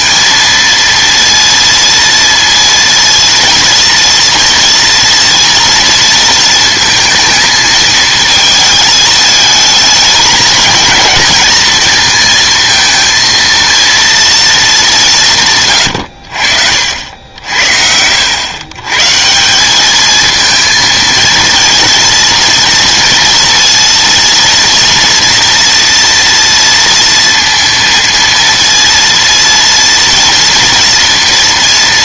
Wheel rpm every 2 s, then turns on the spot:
230, 230, 230, 220, 220, 220, 230, 220, 60, 120, 230, 230, 230, 230, 230, 230.
none